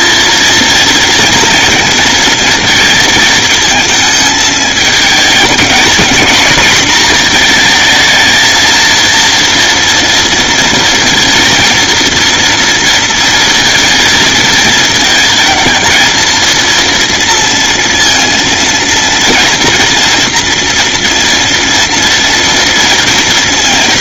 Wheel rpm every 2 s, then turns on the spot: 230, 230, 220, 240, 230, 230, 230, 230, 230, 230, 240, 230.
none